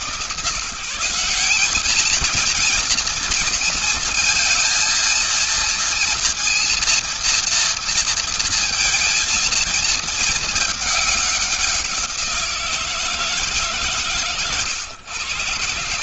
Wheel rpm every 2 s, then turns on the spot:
200, 230, 230, 230, 230, 190, 150, 120.
none